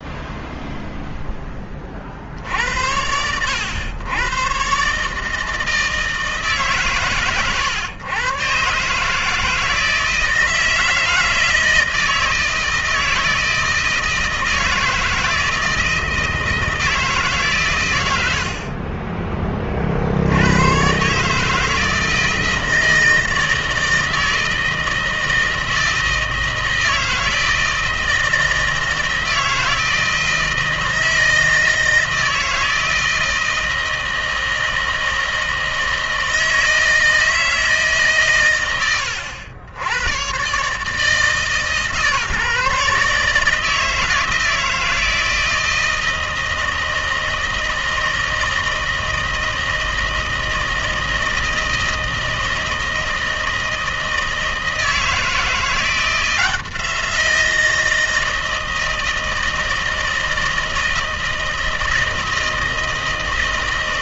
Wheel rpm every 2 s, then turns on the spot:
0, 80, 130, 140, 140, 160, 160, 160, 160, 50, 130, 160, 160, 160, 160, 160, 160, 160, 160, 110, 130, 150, 160, 160, 160, 160, 160, 160, 170, 160, 160, 160.
none